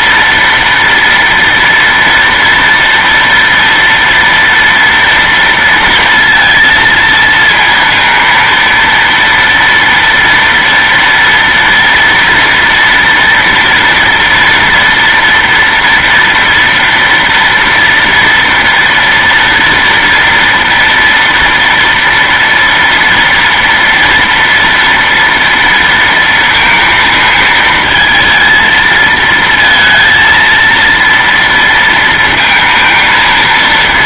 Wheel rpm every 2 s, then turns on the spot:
230, 230, 240, 230, 230, 230, 230, 230, 230, 230, 230, 230, 230, 230, 230, 230, 230.
none